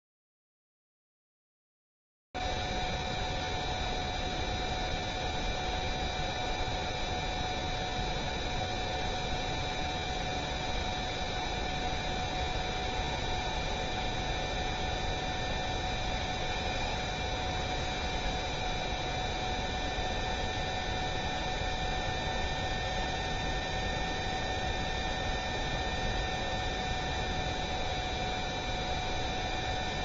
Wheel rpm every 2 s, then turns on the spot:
0, 0, 0, 0, 0, 0, 0, 0, 0, 0, 0, 0, 0, 0, 0.
none